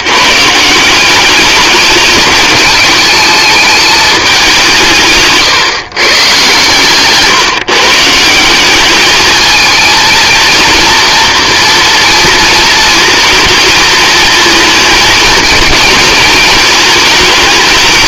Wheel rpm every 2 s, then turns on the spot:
160, 220, 180, 130, 190, 230, 230, 220, 220.
6-8